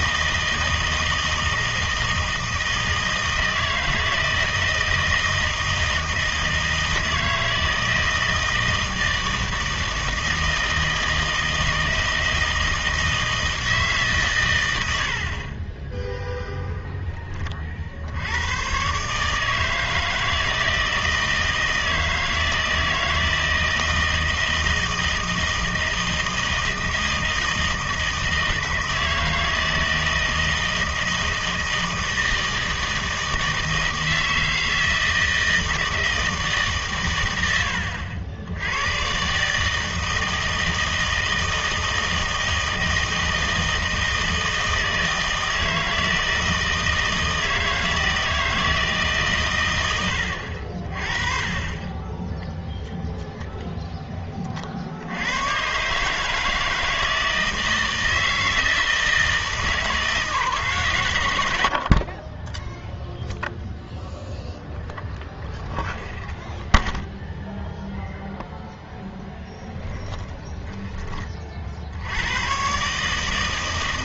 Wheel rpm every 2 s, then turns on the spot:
160, 160, 160, 160, 160, 160, 160, 110, 0, 120, 160, 160, 160, 160, 160, 160, 160, 160, 140, 90, 160, 160, 160, 160, 160, 50, 0, 50, 160, 160, 150, 10, 0, 0, 0, 20, 120.
70-72